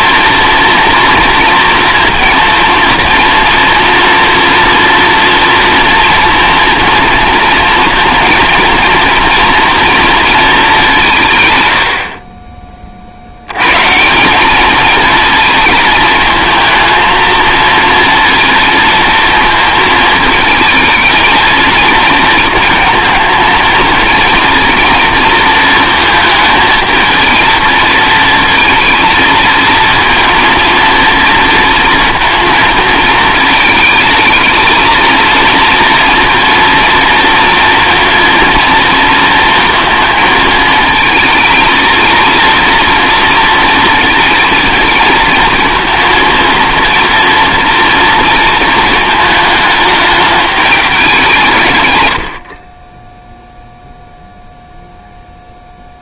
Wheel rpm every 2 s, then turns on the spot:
230, 230, 230, 230, 230, 200, 30, 210, 220, 230, 220, 220, 220, 220, 230, 230, 220, 220, 230, 230, 220, 230, 220, 230, 230, 210, 40, 0.
none